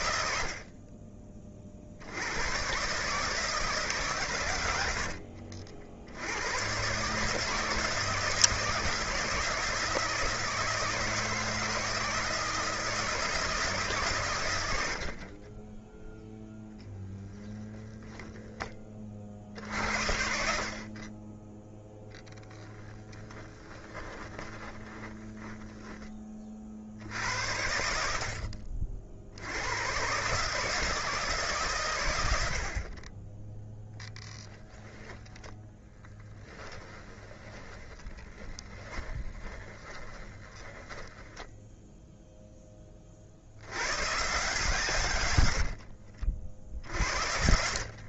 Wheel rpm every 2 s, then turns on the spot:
40, 140, 70, 130, 160, 160, 160, 70, 10, 30, 40, 10, 20, 60, 60, 160, 50, 10, 20, 20, 10, 30, 140, 70.
4-6 16-18 22-26 36-42